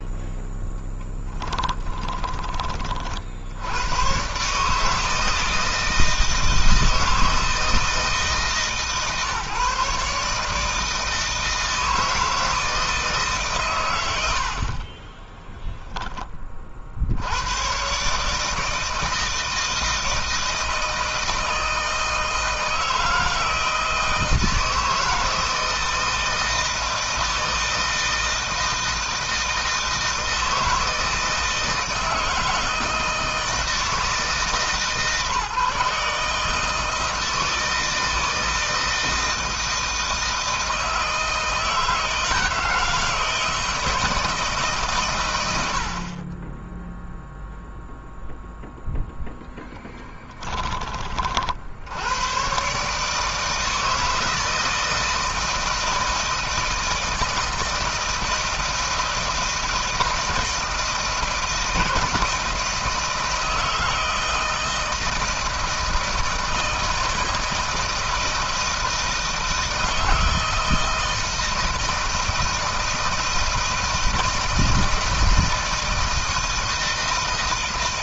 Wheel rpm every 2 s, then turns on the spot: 10, 40, 150, 160, 150, 150, 160, 40, 50, 160, 160, 160, 160, 160, 160, 160, 160, 140, 160, 160, 160, 160, 140, 10, 0, 20, 140, 160, 160, 160, 160, 160, 160, 160, 160, 160, 160, 160, 160.
0-2